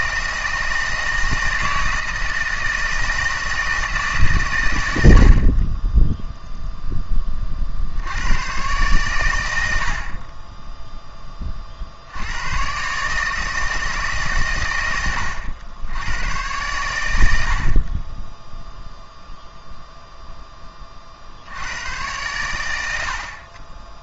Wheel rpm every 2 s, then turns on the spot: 160, 160, 120, 0, 110, 20, 120, 110, 110, 0, 10, 100.
none